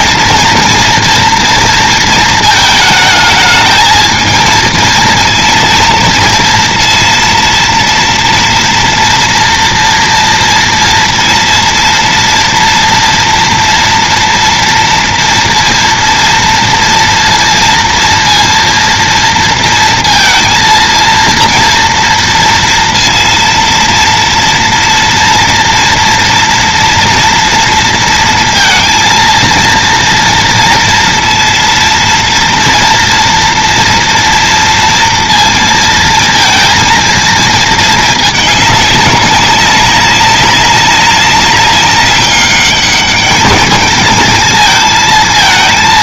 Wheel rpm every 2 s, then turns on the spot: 230, 220, 230, 230, 230, 230, 230, 230, 230, 230, 230, 230, 230, 240, 230, 230, 230, 230, 230, 210, 200, 200, 220.
none